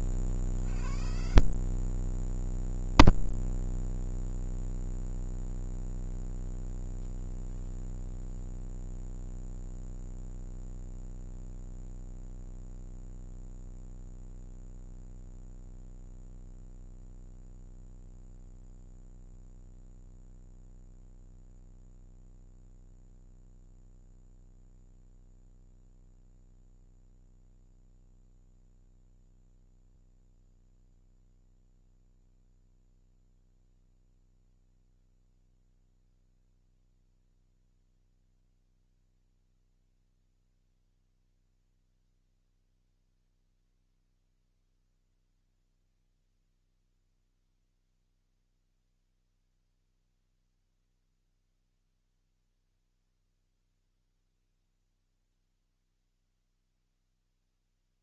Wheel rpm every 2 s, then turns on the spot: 40, 90, 100, 160, 0, 0, 0, 0, 0, 0, 0, 0, 0, 0, 0, 0, 0, 0, 0, 0, 0, 0, 0, 0, 0, 0, 0, 0, 0.
none